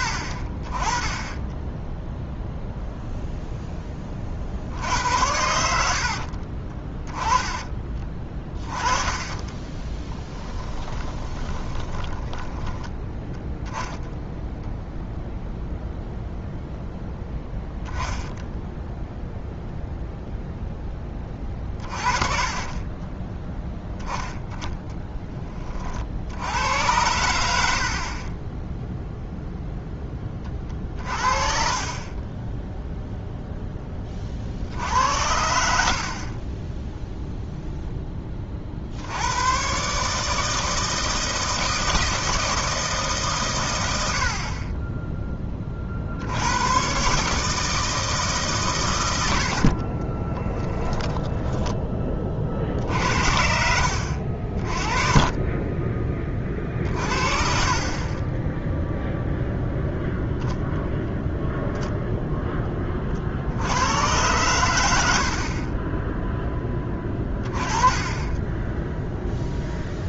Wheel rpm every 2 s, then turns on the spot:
30, 0, 70, 30, 20, 10, 10, 0, 0, 0, 10, 30, 10, 90, 0, 40, 0, 50, 10, 50, 160, 160, 20, 110, 120, 10, 50, 30, 40, 0, 0, 20, 90, 10, 0.
6-8 10-12 30-32 50-52